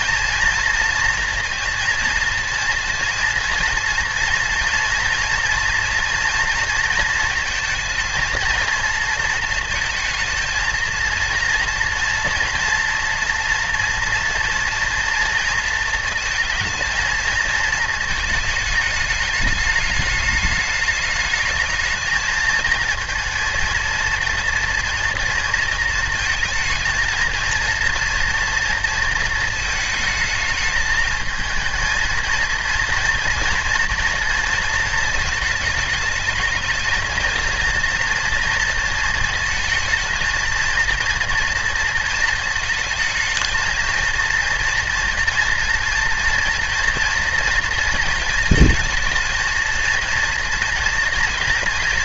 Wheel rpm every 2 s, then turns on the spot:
230, 230, 230, 230, 230, 230, 230, 230, 220, 210, 210, 230, 240, 230, 230, 220, 230, 230, 220, 230, 230, 220, 230, 230, 220, 230.
none